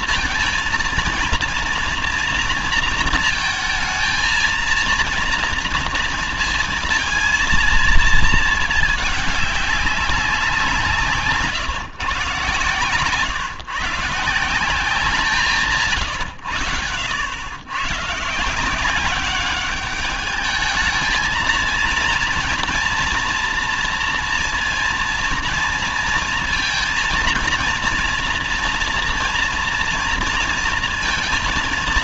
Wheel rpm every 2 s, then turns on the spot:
230, 230, 230, 230, 220, 180, 140, 180, 110, 160, 210, 230, 230, 230, 240, 230.
none